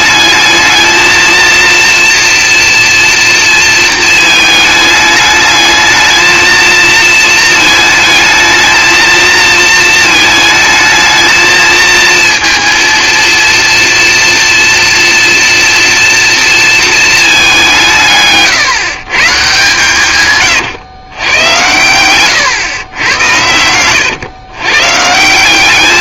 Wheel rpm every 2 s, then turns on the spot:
220, 240, 220, 230, 220, 220, 230, 230, 230, 140, 130, 120, 120.
20-24